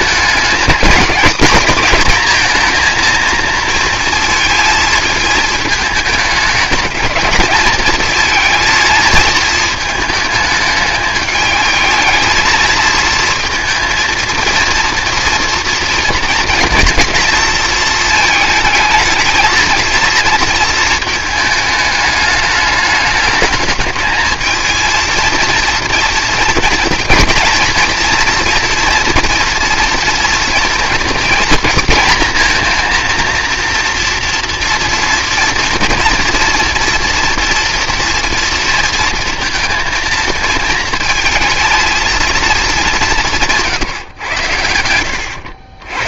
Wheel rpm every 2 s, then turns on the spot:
220, 230, 230, 210, 220, 220, 220, 230, 230, 220, 220, 210, 230, 230, 240, 230, 230, 230, 240, 230, 230, 210, 90.
none